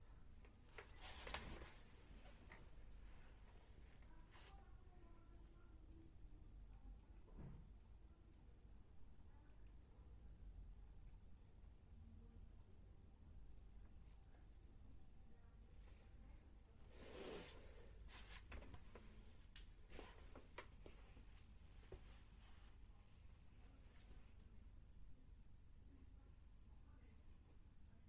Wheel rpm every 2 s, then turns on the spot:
0, 0, 0, 0, 0, 0, 0, 0, 0, 0, 0, 0, 0, 0.
none